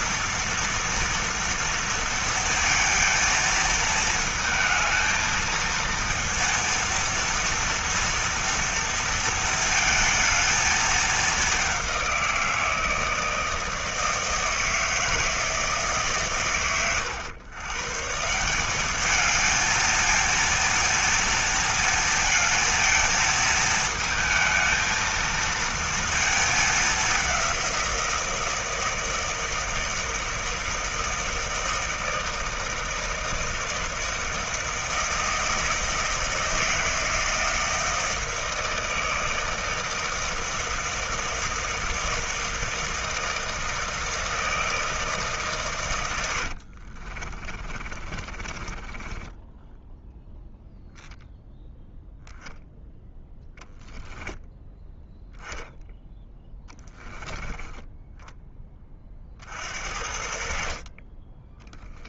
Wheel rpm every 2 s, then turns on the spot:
230, 230, 220, 230, 230, 220, 170, 160, 100, 200, 230, 220, 220, 200, 170, 160, 160, 160, 160, 160, 160, 160, 160, 50, 20, 0, 0, 10, 10, 30, 40.
46-50